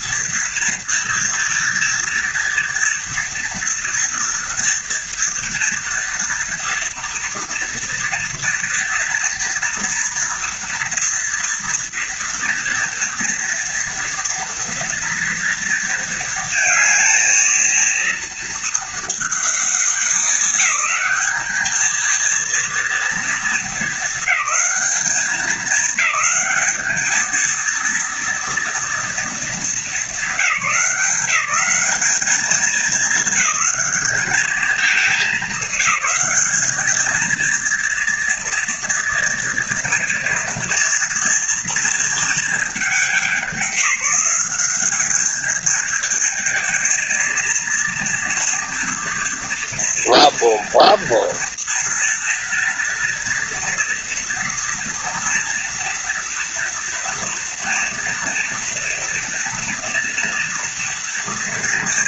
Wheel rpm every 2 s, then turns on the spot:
230, 230, 240, 230, 230, 230, 240, 230, 220, 220, 210, 230, 200, 220, 230, 170, 210, 210, 210, 230, 230, 200, 190, 220, 230, 230, 240, 240, 230, 230, 230.
none